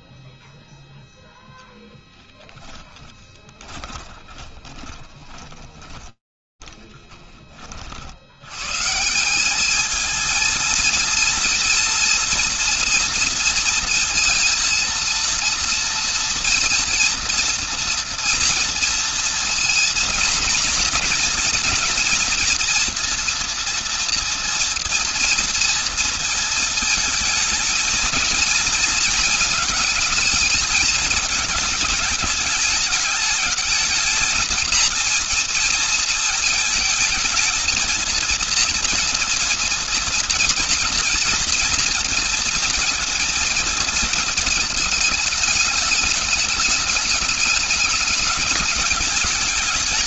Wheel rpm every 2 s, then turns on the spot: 0, 10, 20, 30, 170, 230, 230, 230, 230, 240, 230, 230, 230, 220, 220, 220, 210, 230, 220, 230, 230, 230, 220, 210, 210.
2-8